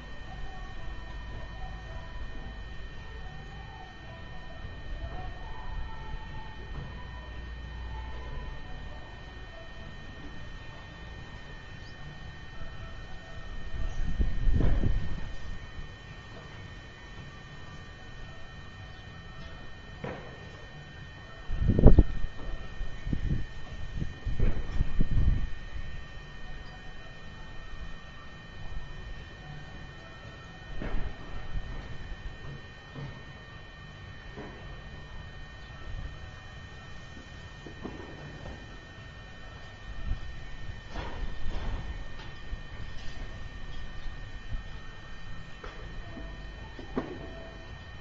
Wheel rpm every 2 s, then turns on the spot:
0, 0, 0, 0, 0, 0, 0, 0, 0, 0, 0, 0, 0, 0, 0, 0, 0, 0, 0, 0, 0, 0, 0, 0.
none